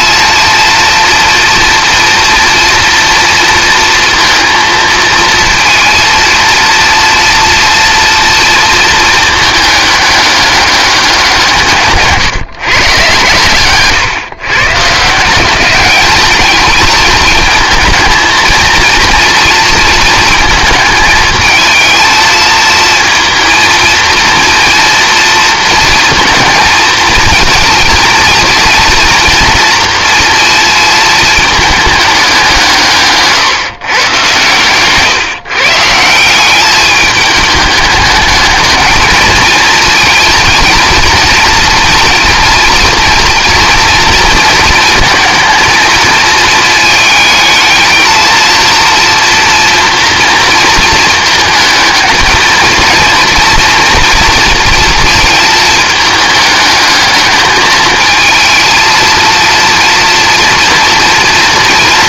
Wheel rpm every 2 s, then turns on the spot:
230, 230, 220, 230, 220, 190, 130, 160, 220, 230, 220, 230, 230, 230, 230, 220, 150, 130, 210, 220, 230, 230, 230, 220, 240, 220, 230, 230, 210, 220, 230.
none